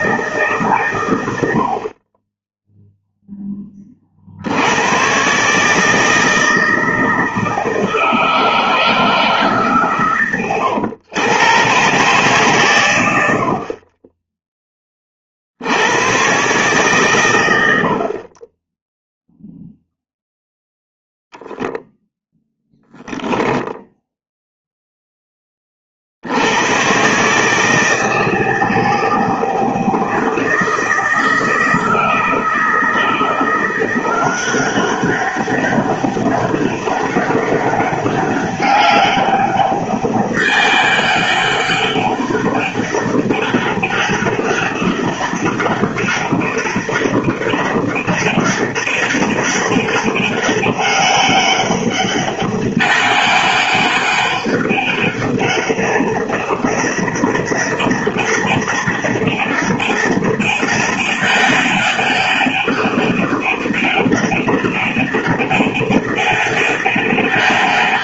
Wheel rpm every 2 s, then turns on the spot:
130, 0, 100, 160, 160, 110, 120, 20, 130, 10, 0, 0, 0, 90, 160, 160, 170, 190, 200, 200, 200, 200, 200, 200, 200, 200, 200, 200, 200, 200, 200, 200, 200, 200.
none